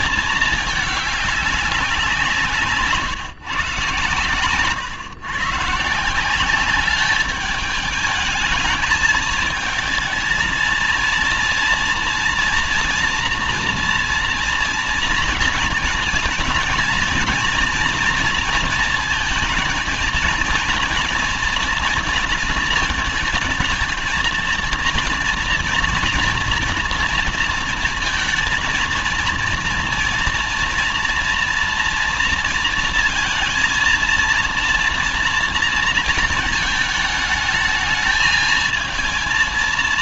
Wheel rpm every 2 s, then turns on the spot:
220, 160, 120, 200, 220, 230, 230, 230, 230, 230, 230, 230, 230, 230, 230, 230, 230, 230, 220, 220.
none